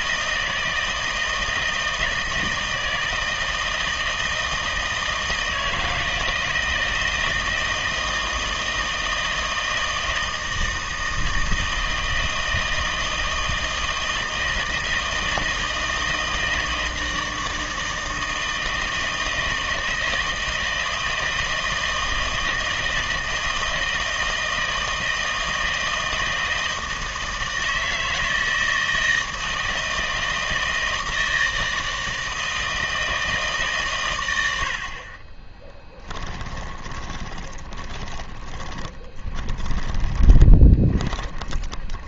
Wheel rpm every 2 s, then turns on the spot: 160, 160, 160, 160, 160, 160, 160, 160, 160, 160, 160, 160, 160, 160, 160, 160, 160, 60, 20, 10, 20.
36-42